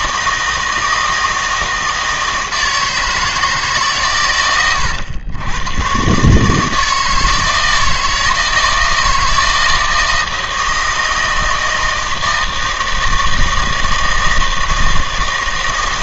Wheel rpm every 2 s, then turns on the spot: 160, 160, 110, 160, 160, 160, 160, 160.
none